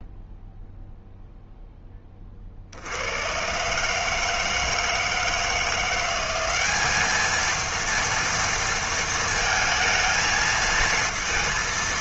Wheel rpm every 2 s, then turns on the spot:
0, 50, 160, 200, 230, 220.
none